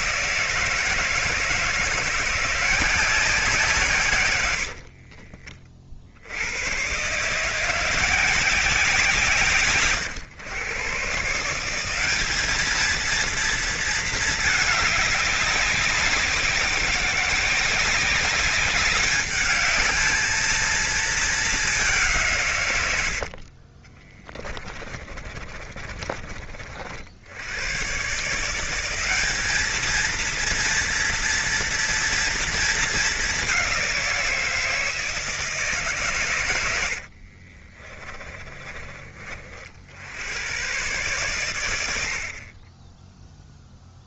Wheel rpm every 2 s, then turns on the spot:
160, 180, 80, 110, 190, 130, 220, 210, 190, 200, 220, 110, 30, 50, 180, 230, 220, 160, 80, 30, 110, 20.
4-6 24-26 36-38